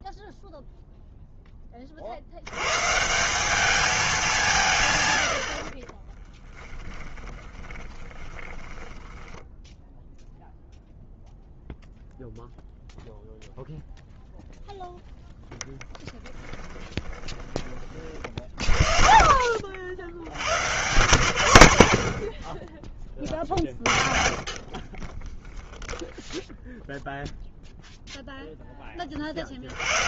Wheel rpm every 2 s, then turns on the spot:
0, 120, 160, 10, 10, 0, 0, 0, 20, 40, 130, 30, 30, 0, 10.
6-10 16-18